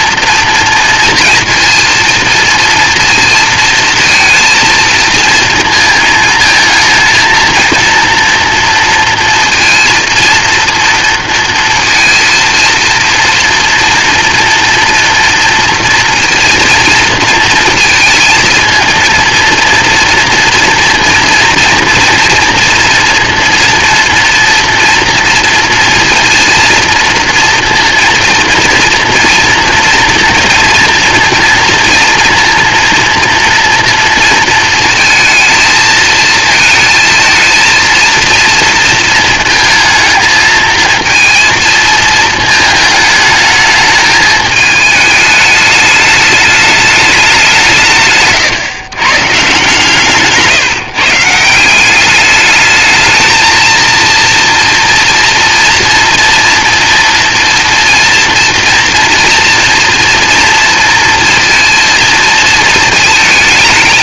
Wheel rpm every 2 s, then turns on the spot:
240, 230, 230, 220, 230, 230, 230, 230, 230, 230, 240, 230, 240, 230, 230, 230, 230, 230, 230, 220, 220, 220, 210, 210, 130, 150, 220, 230, 230, 230, 230, 220.
none